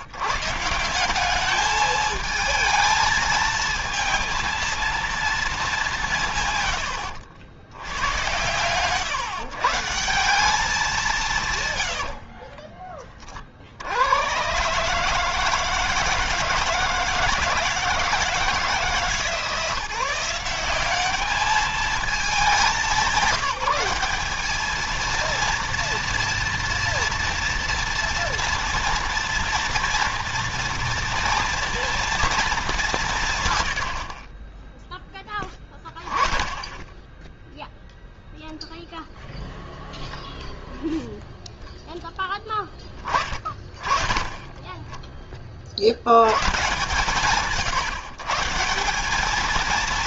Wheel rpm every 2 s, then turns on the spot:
170, 220, 230, 110, 120, 180, 30, 150, 160, 160, 200, 200, 220, 230, 230, 230, 190, 10, 10, 0, 0, 20, 20, 130, 190.
none